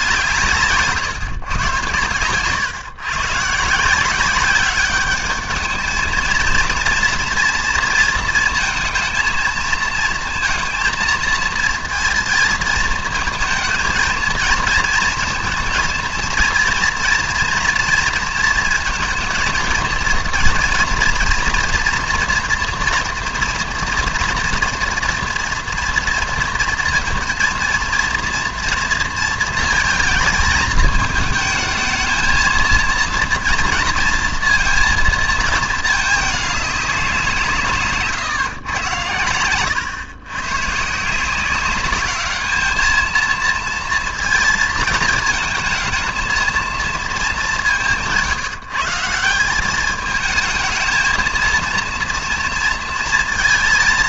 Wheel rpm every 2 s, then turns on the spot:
160, 130, 190, 230, 230, 230, 230, 220, 230, 230, 230, 230, 230, 230, 230, 220, 230, 230, 210, 120, 130, 210, 230, 230, 160, 220, 230.
none